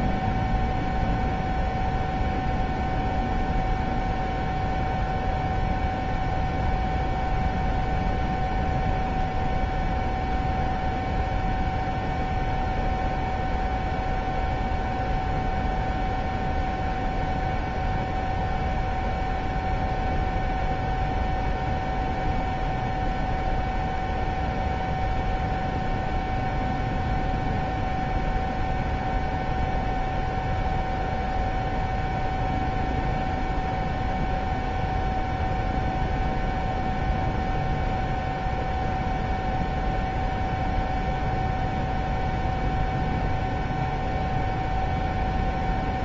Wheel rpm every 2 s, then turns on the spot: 0, 0, 0, 0, 0, 0, 0, 0, 0, 0, 0, 0, 0, 0, 0, 0, 0, 0, 0, 0, 0, 0, 0.
none